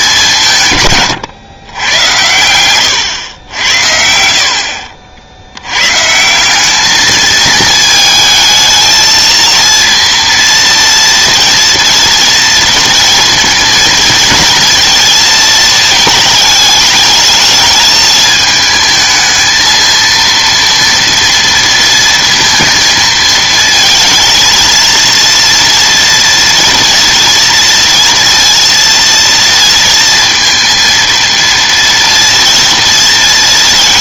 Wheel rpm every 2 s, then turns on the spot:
170, 100, 60, 190, 220, 230, 230, 230, 210, 220, 230, 220, 230, 230, 230, 230, 230.
none